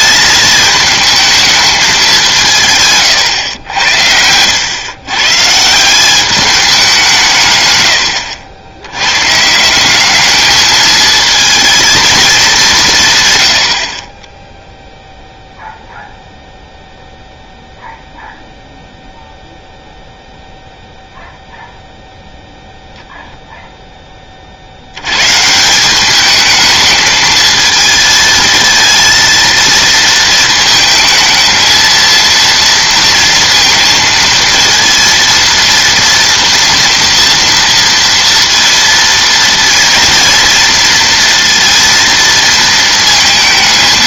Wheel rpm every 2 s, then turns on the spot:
210, 150, 100, 200, 80, 210, 190, 0, 0, 0, 0, 0, 70, 220, 220, 220, 230, 230, 230, 230, 230, 230.
none